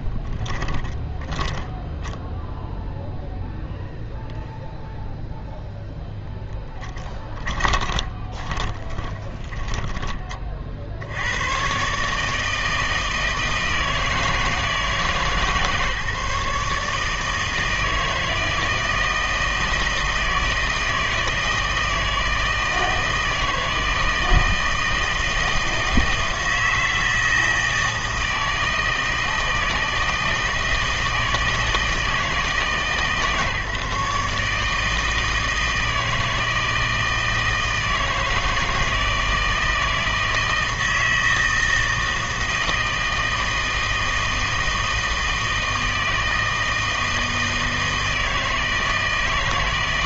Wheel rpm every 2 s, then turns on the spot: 10, 0, 0, 10, 20, 50, 160, 160, 150, 160, 160, 160, 160, 160, 160, 160, 160, 160, 160, 160, 160, 160, 160, 160, 160.
0-2 6-10